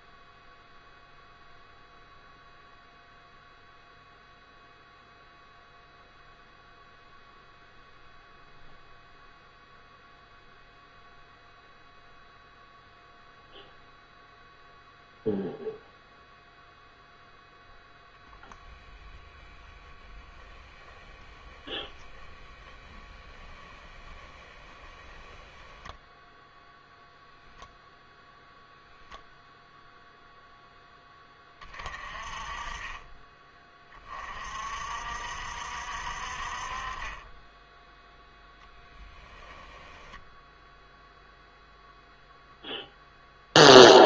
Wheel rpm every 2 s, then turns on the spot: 0, 0, 0, 0, 0, 0, 0, 0, 0, 20, 10, 10, 10, 0, 0, 0, 20, 50, 40, 10, 0, 0.
18-26